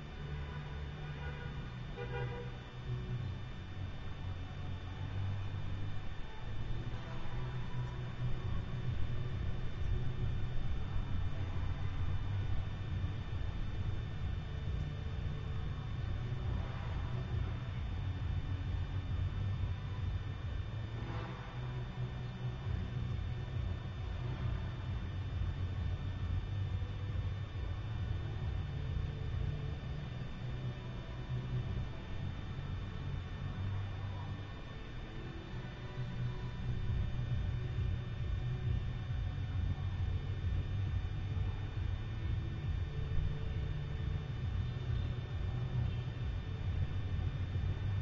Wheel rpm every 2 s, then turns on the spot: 0, 0, 0, 0, 0, 0, 0, 0, 0, 0, 0, 0, 0, 0, 0, 0, 0, 0, 0, 0, 0, 0, 0, 0.
none